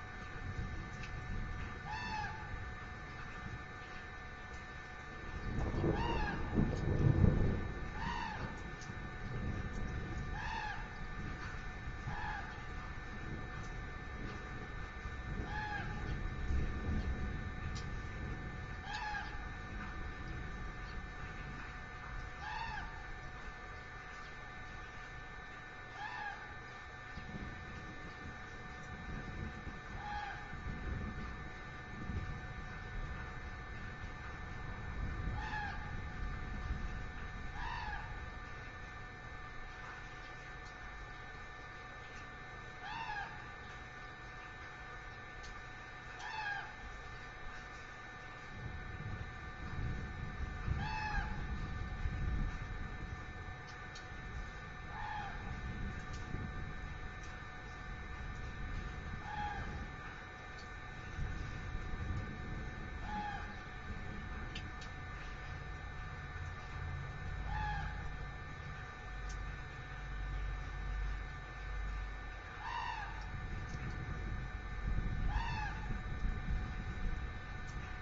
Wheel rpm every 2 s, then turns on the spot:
0, 0, 0, 0, 0, 0, 0, 0, 0, 0, 0, 0, 0, 0, 0, 0, 0, 0, 0, 0, 0, 0, 0, 0, 0, 0, 0, 0, 0, 0, 0, 0, 0, 0, 0, 0, 0, 0, 0.
none